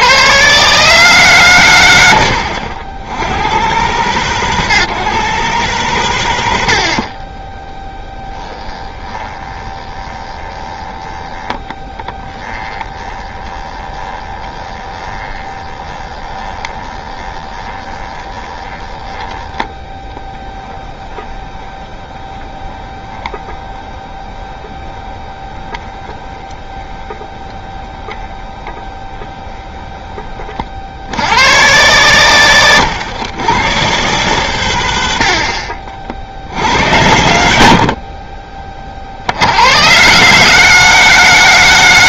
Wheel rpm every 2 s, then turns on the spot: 100, 110, 130, 120, 10, 20, 20, 20, 20, 20, 10, 20, 20, 20, 20, 50, 120, 100, 100, 30, 160.
8-30